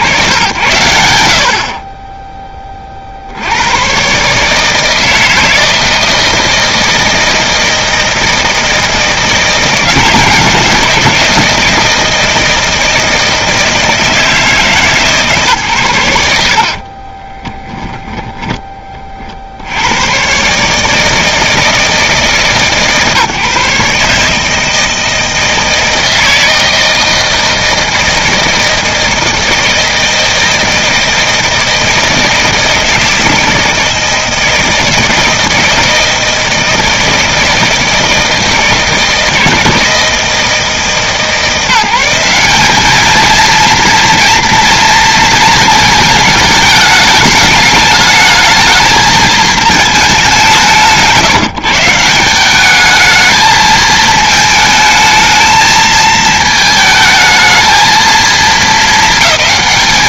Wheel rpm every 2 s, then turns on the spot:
70, 30, 160, 160, 160, 170, 160, 150, 60, 20, 150, 140, 160, 160, 160, 160, 160, 160, 160, 160, 160, 210, 240, 210, 220, 170, 210, 220, 220, 220.
16-18